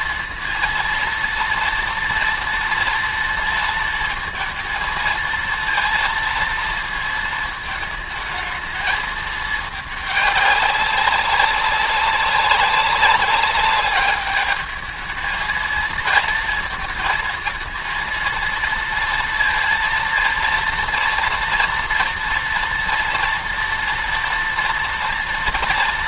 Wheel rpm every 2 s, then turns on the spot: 230, 230, 230, 230, 220, 200, 200, 210, 230, 230, 230, 230, 230.
none